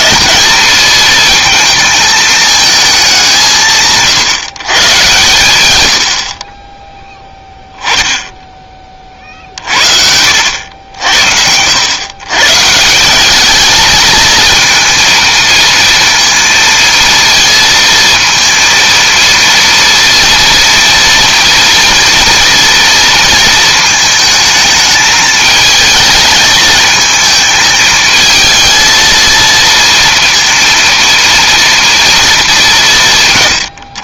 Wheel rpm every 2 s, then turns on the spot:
220, 220, 130, 20, 20, 70, 150, 220, 230, 230, 230, 230, 220, 220, 220, 230, 190.
none